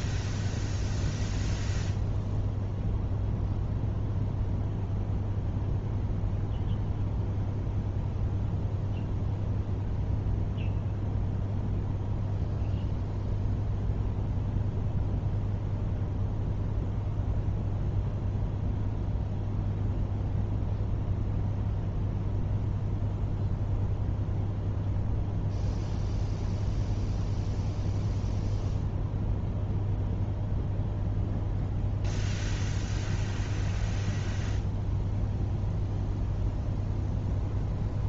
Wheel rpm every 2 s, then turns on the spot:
0, 0, 0, 0, 0, 0, 0, 0, 0, 0, 0, 0, 0, 0, 0, 0, 0, 0, 0.
none